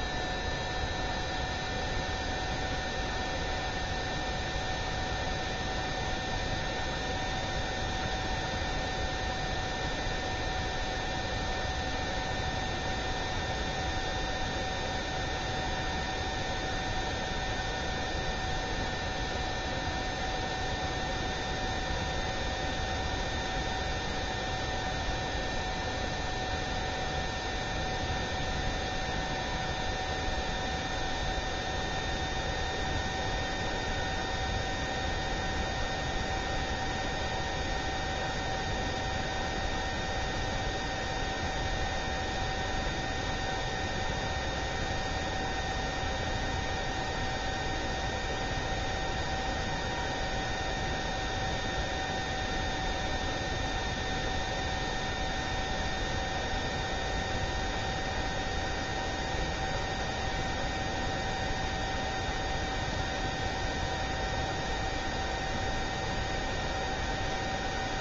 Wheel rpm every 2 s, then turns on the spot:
0, 0, 0, 0, 0, 0, 0, 0, 0, 0, 0, 0, 0, 0, 0, 0, 0, 0, 0, 0, 0, 0, 0, 0, 0, 0, 0, 0, 0, 0, 0, 0, 0, 0.
none